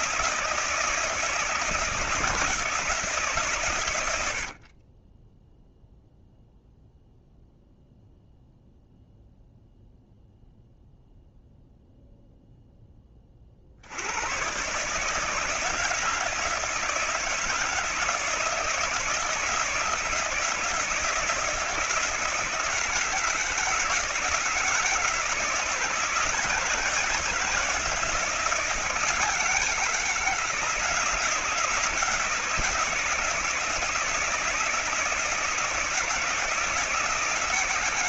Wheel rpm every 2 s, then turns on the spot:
160, 160, 50, 0, 0, 0, 0, 120, 160, 160, 170, 160, 160, 170, 170, 160, 160, 160, 160.
none